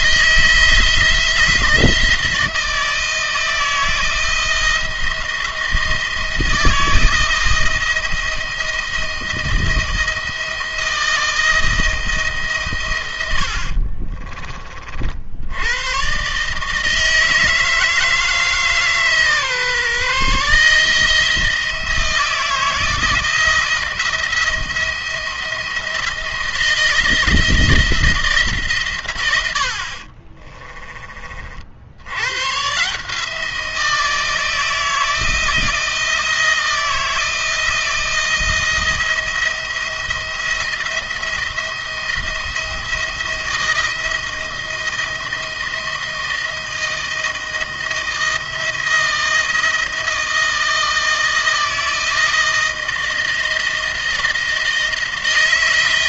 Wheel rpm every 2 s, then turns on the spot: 160, 160, 170, 160, 160, 160, 110, 50, 160, 150, 160, 160, 170, 170, 140, 30, 140, 160, 160, 170, 170, 170, 170, 160, 160, 160, 170, 160.
none